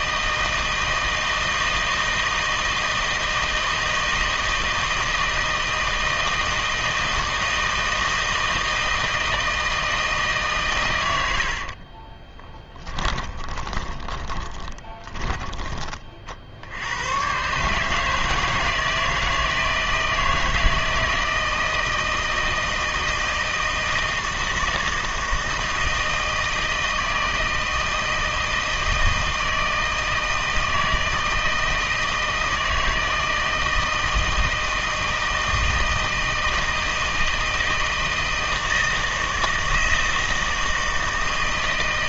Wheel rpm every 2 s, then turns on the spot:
160, 160, 160, 160, 160, 130, 20, 20, 60, 160, 160, 160, 160, 160, 160, 160, 160, 160, 160, 160, 160.
12-16